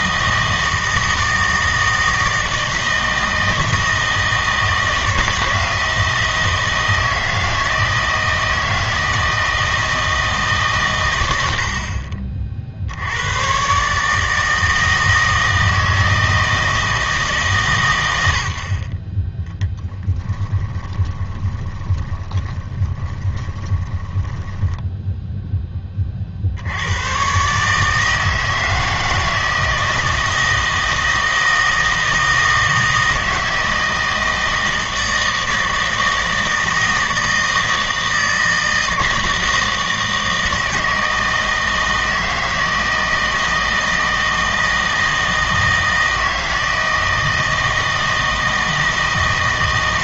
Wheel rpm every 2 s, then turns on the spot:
160, 160, 160, 160, 160, 140, 50, 160, 160, 50, 20, 20, 10, 80, 160, 160, 160, 160, 160, 160, 160, 160, 160, 160, 160.
20-26